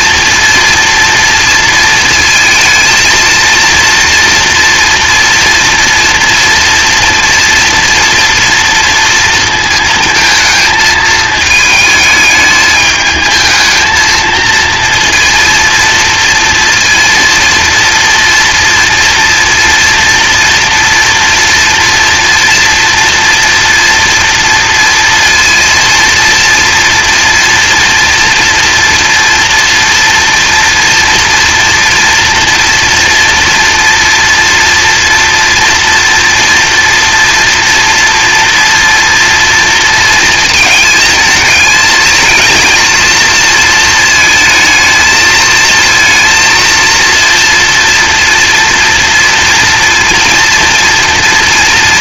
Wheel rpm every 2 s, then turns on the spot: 230, 230, 240, 230, 230, 220, 210, 230, 230, 240, 230, 230, 240, 230, 230, 230, 230, 230, 240, 240, 220, 220, 220, 230, 230, 240.
none